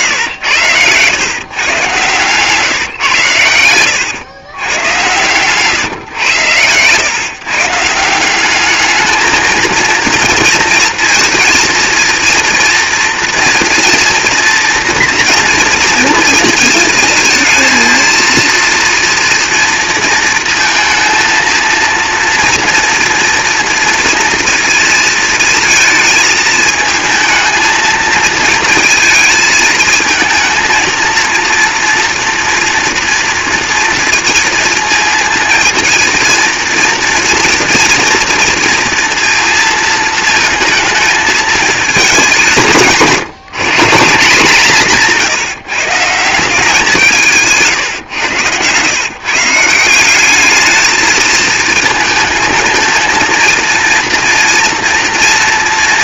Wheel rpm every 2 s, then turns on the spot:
100, 140, 110, 110, 210, 230, 230, 230, 220, 230, 230, 230, 230, 220, 230, 220, 230, 230, 230, 230, 220, 170, 170, 170, 120, 210, 220, 230.
0-2